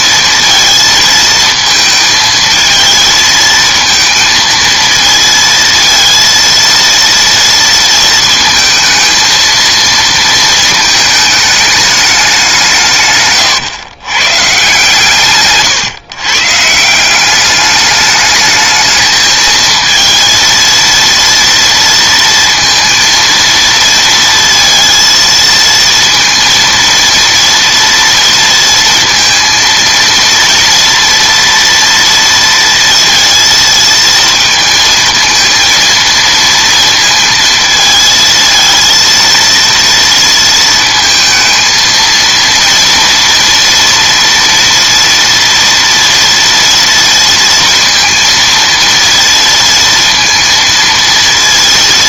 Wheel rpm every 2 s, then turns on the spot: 230, 220, 230, 230, 230, 220, 170, 140, 150, 210, 230, 230, 230, 230, 230, 230, 230, 230, 230, 220, 230, 230, 240, 230, 230, 230.
none